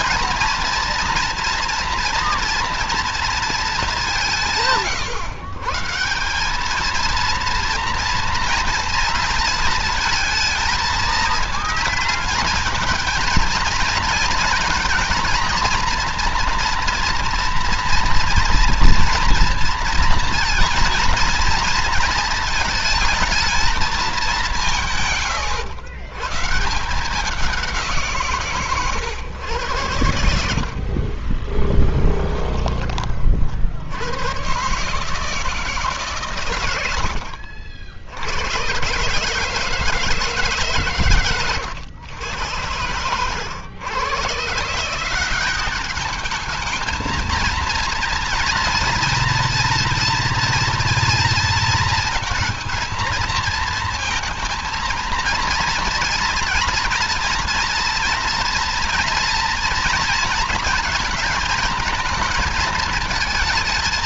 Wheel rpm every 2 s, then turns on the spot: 230, 230, 150, 220, 240, 220, 230, 230, 240, 230, 230, 220, 170, 160, 140, 60, 40, 130, 110, 120, 130, 110, 170, 220, 230, 230, 220, 230, 230, 240, 220, 220.
none